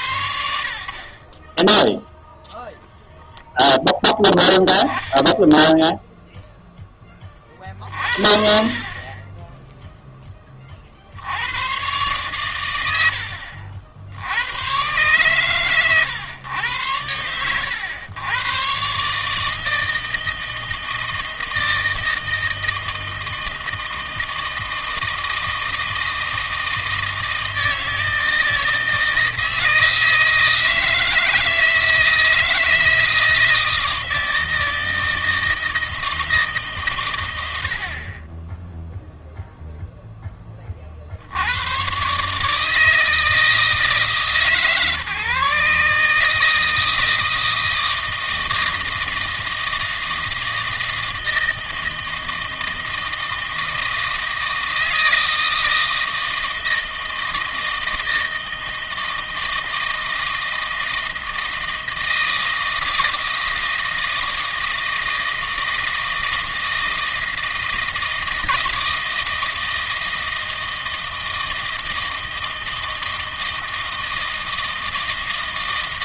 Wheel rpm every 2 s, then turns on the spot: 60, 0, 10, 10, 30, 50, 90, 120, 100, 130, 160, 160, 160, 160, 160, 160, 160, 160, 130, 10, 40, 160, 150, 160, 160, 160, 160, 160, 160, 160, 160, 160, 160, 160, 160, 160, 160, 160.
none